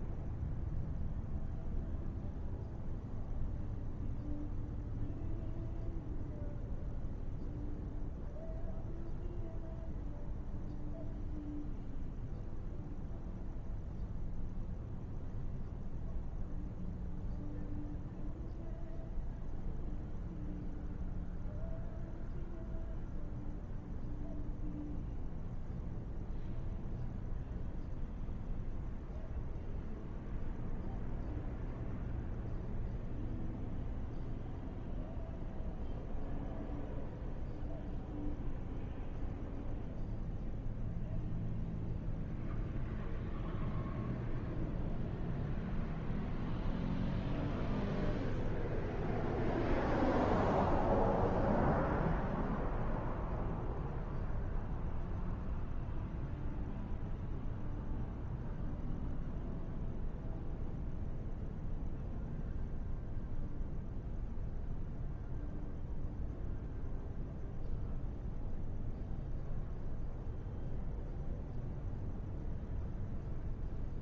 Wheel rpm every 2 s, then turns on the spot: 0, 0, 0, 0, 0, 0, 0, 0, 0, 0, 0, 0, 0, 0, 0, 0, 0, 0, 0, 0, 0, 0, 0, 0, 0, 0, 0, 0, 0, 0, 0, 0, 0, 0, 0, 0, 0.
none